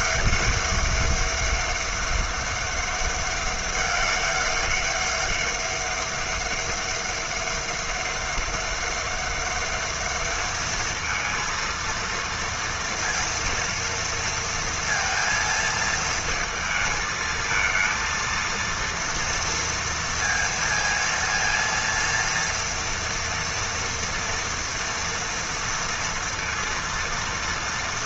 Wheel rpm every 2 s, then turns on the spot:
200, 200, 200, 200, 200, 220, 230, 230, 220, 230, 230, 230, 230, 230.
none